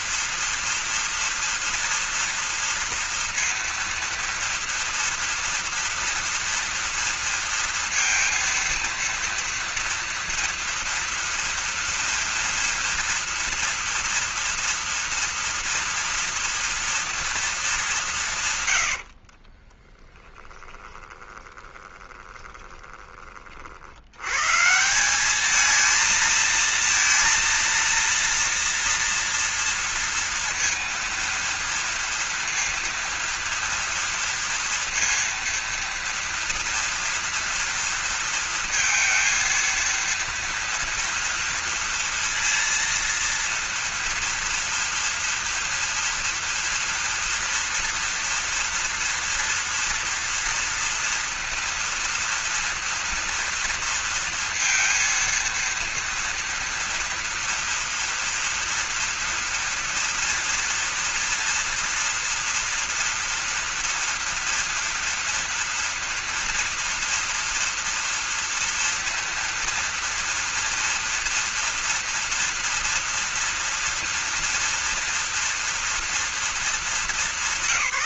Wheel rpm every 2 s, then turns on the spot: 240, 230, 230, 240, 230, 230, 230, 230, 230, 110, 20, 20, 160, 230, 230, 230, 230, 230, 230, 230, 230, 230, 230, 230, 230, 230, 230, 230, 240, 240, 230, 230, 230, 230, 230, 230, 230, 240, 210.
20-24